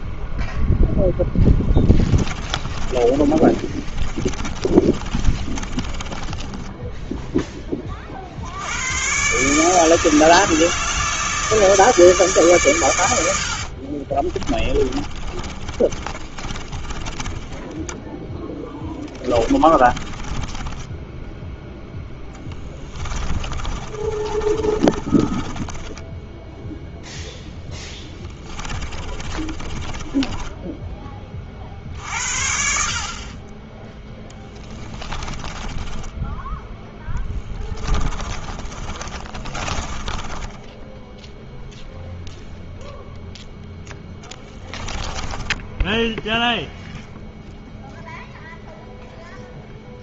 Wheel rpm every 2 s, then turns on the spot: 0, 40, 30, 10, 80, 160, 130, 30, 30, 10, 10, 20, 30, 0, 20, 10, 50, 20, 10, 30, 20, 0, 10, 0, 0.
2-8 14-26 28-30 34-36 38-42 44-46